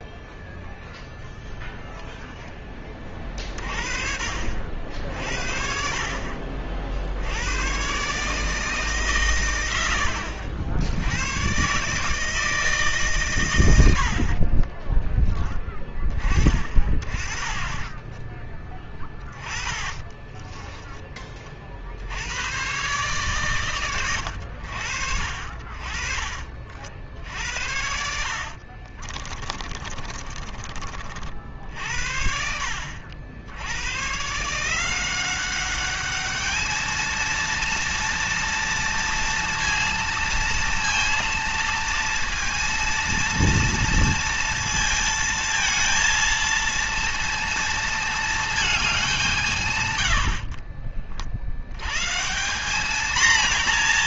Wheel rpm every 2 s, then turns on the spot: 0, 10, 60, 50, 140, 60, 150, 30, 30, 10, 20, 110, 80, 50, 40, 30, 70, 160, 210, 230, 230, 230, 230, 230, 210, 60, 190.
14-16 18-22 28-30 50-52